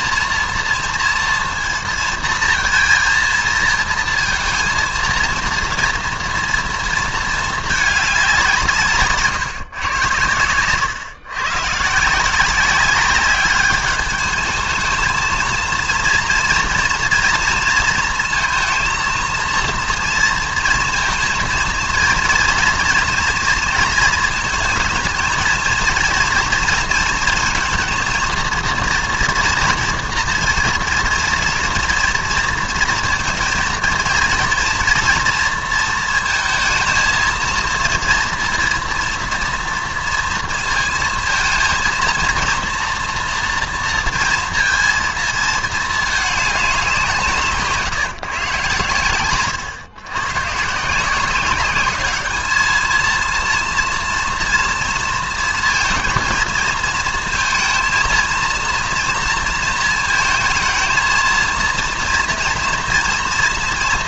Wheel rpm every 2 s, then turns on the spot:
230, 230, 230, 230, 160, 120, 190, 220, 230, 230, 230, 240, 220, 230, 230, 240, 230, 230, 230, 230, 230, 230, 230, 180, 130, 160, 220, 230, 230, 230, 220, 230.
none